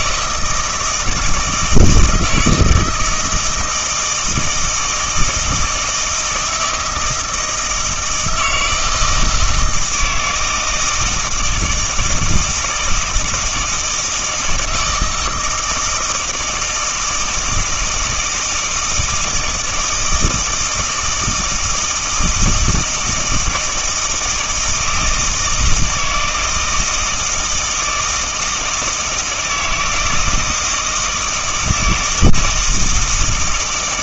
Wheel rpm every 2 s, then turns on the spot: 160, 160, 160, 160, 160, 160, 160, 160, 160, 160, 160, 170, 160, 160, 160, 160, 160.
none